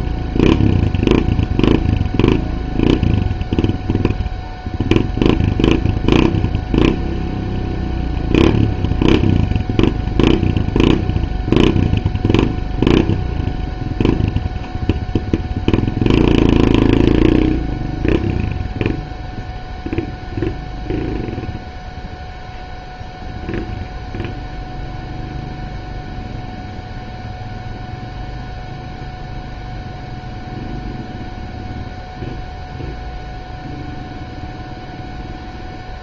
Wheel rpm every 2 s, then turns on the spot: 0, 0, 0, 0, 0, 0, 0, 0, 0, 0, 0, 0, 0, 0, 0, 0, 0, 0.
none